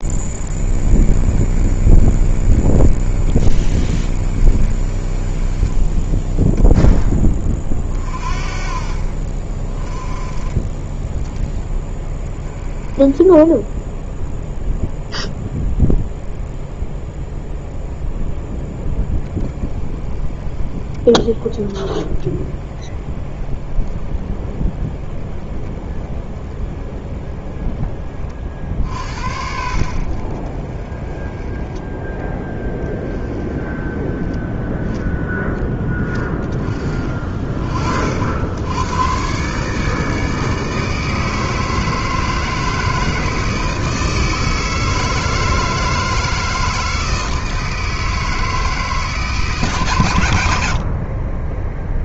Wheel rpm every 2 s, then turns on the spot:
30, 40, 40, 10, 40, 20, 20, 0, 0, 0, 10, 20, 20, 20, 40, 30, 10, 10, 20, 90, 160, 160, 160, 160, 160, 80.
none